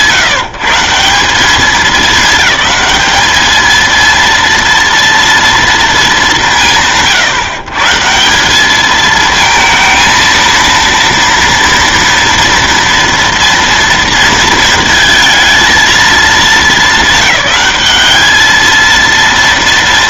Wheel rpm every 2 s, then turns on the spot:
140, 200, 230, 130, 220, 230, 230, 230, 220, 220.
none